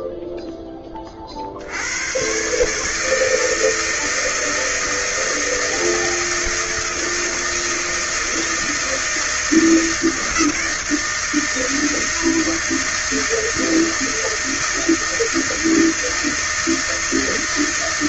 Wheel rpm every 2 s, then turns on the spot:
10, 130, 160, 160, 160, 160, 160, 160, 160.
none